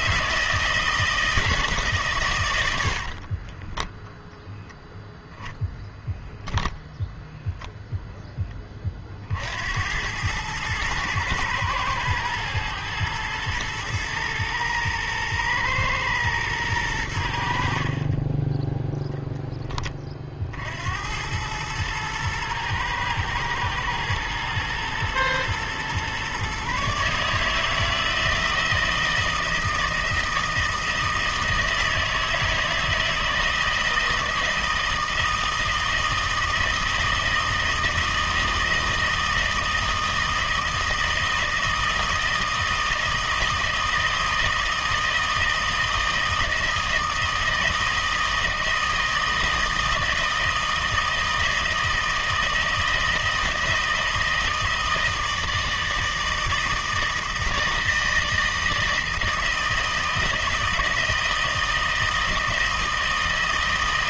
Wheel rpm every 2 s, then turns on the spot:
160, 110, 0, 0, 10, 100, 110, 110, 110, 20, 50, 110, 110, 140, 160, 160, 160, 160, 160, 160, 160, 160, 160, 160, 160, 160, 160, 160, 160, 160, 160, 160.
18-20